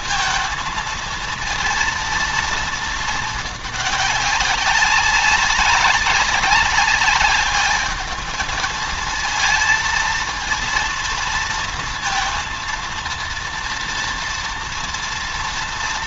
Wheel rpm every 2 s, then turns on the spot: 230, 220, 190, 200, 220, 230, 230, 230.
none